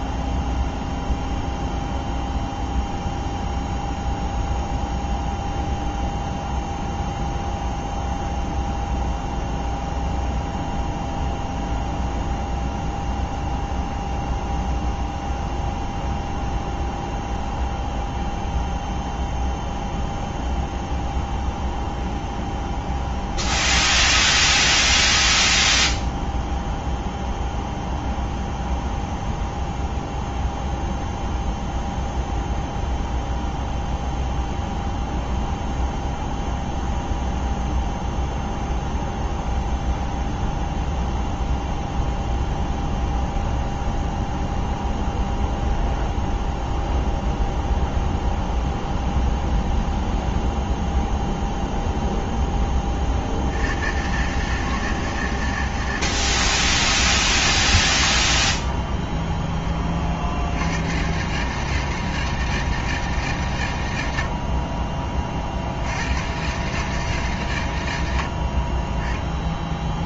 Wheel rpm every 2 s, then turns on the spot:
0, 0, 0, 0, 0, 0, 0, 0, 0, 0, 0, 0, 0, 0, 0, 0, 0, 0, 0, 0, 0, 0, 0, 0, 0, 0, 40, 140, 120, 20, 110, 150, 30, 140, 20.
58-60